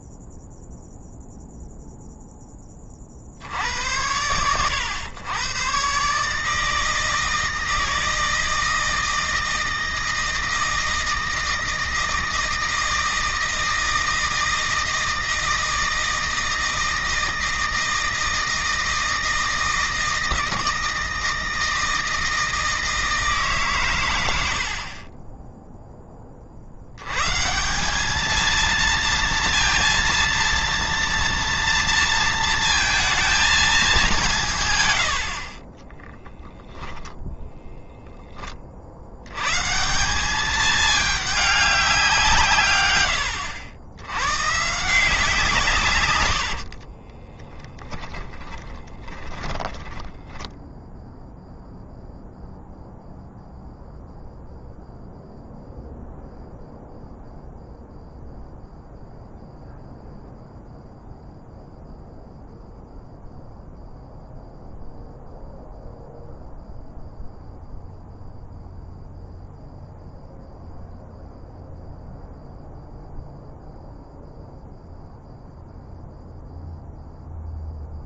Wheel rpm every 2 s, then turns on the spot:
0, 30, 100, 160, 160, 160, 160, 160, 160, 160, 160, 160, 50, 90, 230, 230, 230, 130, 10, 60, 210, 110, 140, 70, 10, 0, 0, 0, 0, 0, 0, 0, 0, 0, 0, 0, 0, 0, 0.
46-50